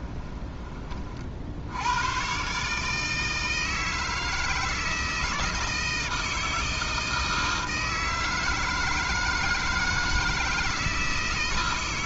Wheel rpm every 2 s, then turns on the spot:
30, 150, 160, 160, 160, 160.
none